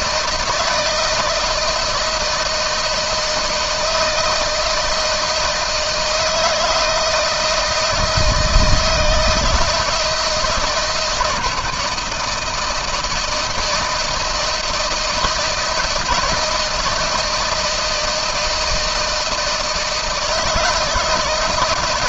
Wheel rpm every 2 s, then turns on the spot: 160, 160, 160, 160, 160, 160, 160, 160, 160, 170, 160.
none